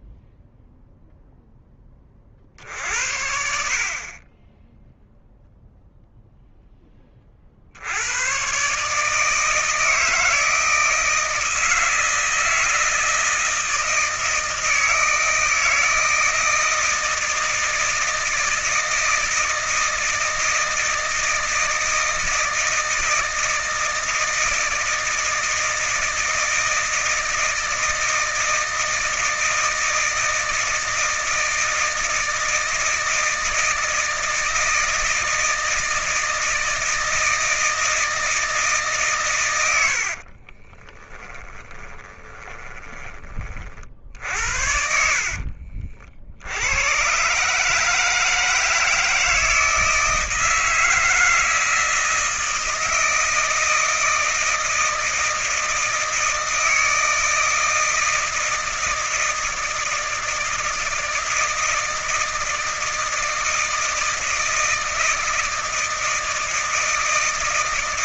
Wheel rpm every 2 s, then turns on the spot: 0, 40, 20, 0, 110, 160, 160, 160, 160, 160, 160, 160, 160, 160, 160, 160, 160, 160, 160, 160, 40, 20, 60, 70, 160, 160, 160, 160, 160, 160, 160, 160, 160, 160.
40-44